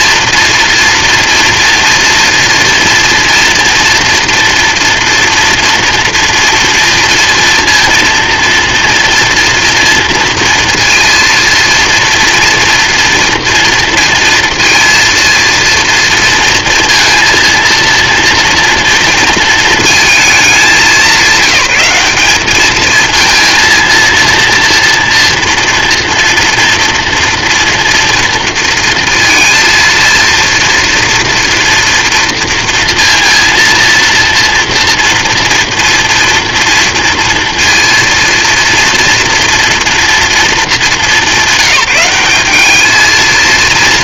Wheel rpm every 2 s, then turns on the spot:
230, 230, 240, 230, 230, 230, 230, 230, 230, 230, 200, 210, 230, 230, 230, 230, 230, 230, 230, 230, 220, 200.
none